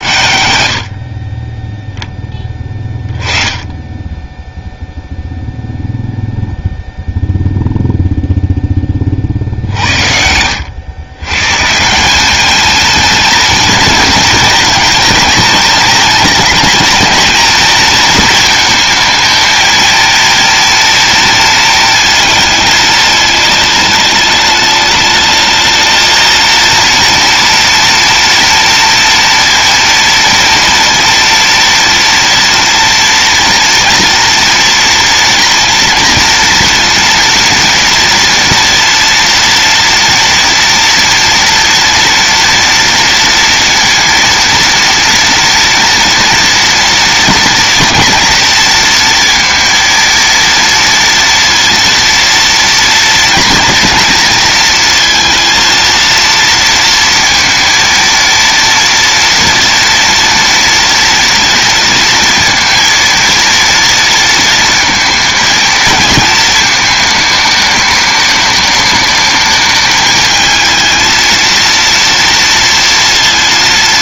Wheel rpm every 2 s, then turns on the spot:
50, 10, 0, 0, 20, 110, 220, 230, 220, 220, 230, 220, 210, 230, 230, 230, 230, 230, 230, 230, 230, 240, 230, 230, 230, 230, 230, 230, 230, 230, 230, 230, 230, 220, 210, 230, 230.
none